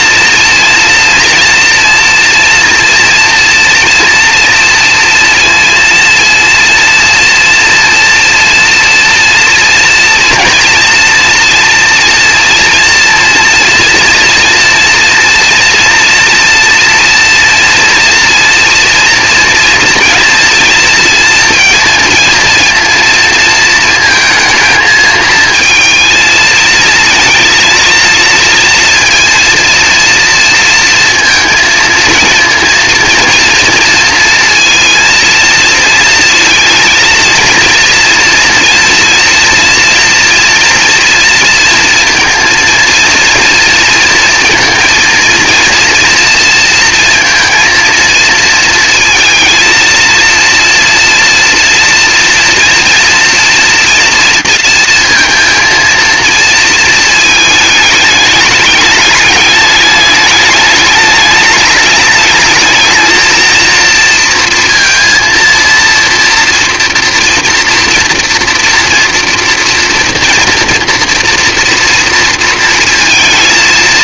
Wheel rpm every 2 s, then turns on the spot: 230, 240, 240, 230, 230, 230, 240, 240, 230, 230, 230, 230, 220, 230, 230, 230, 230, 230, 230, 230, 240, 230, 230, 230, 230, 230, 230, 230, 230, 220, 210, 210, 230, 230, 230, 230, 230.
none